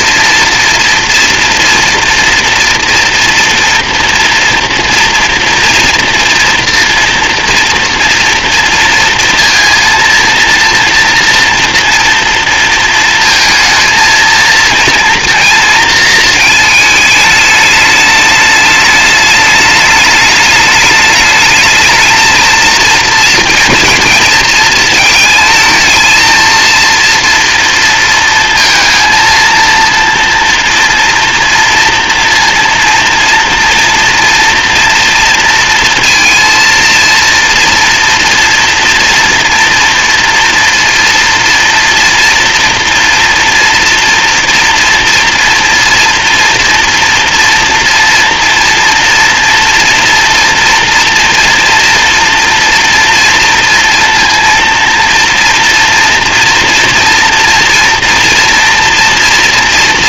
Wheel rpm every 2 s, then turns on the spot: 230, 230, 230, 230, 230, 230, 230, 230, 220, 210, 210, 230, 220, 230, 230, 230, 230, 230, 230, 230, 230, 230, 240, 240, 230, 230, 230, 230, 230, 230.
none